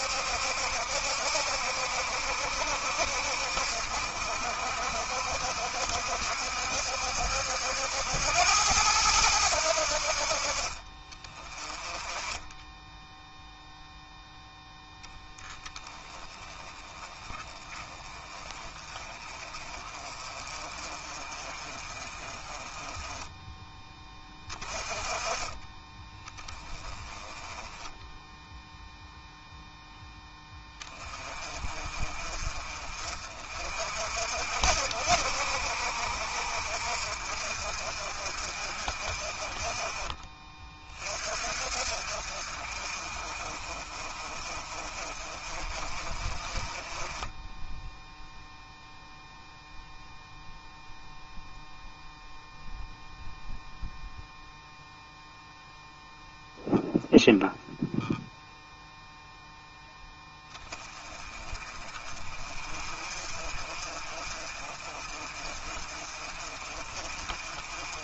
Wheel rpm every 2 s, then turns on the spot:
70, 60, 60, 70, 90, 30, 10, 0, 20, 30, 30, 20, 20, 20, 0, 20, 40, 60, 50, 50, 40, 40, 40, 20, 0, 0, 0, 0, 0, 0, 20, 40, 40, 40.
none